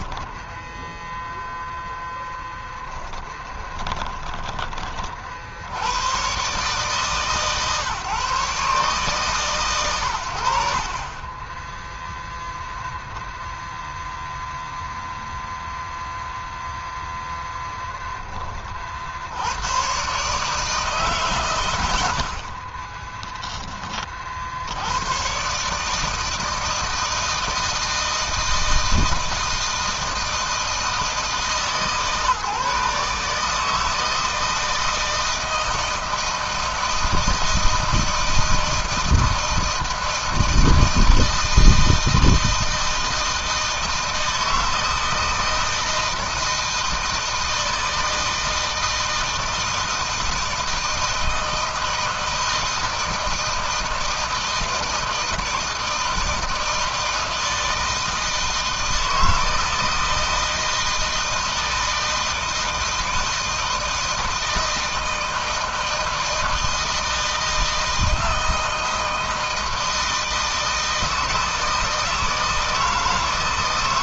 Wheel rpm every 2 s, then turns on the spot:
0, 10, 50, 140, 140, 30, 0, 0, 0, 70, 130, 10, 120, 160, 160, 160, 150, 160, 160, 160, 160, 160, 160, 160, 160, 160, 160, 160, 160, 160, 160, 160, 160, 160, 160, 160, 160.
2-4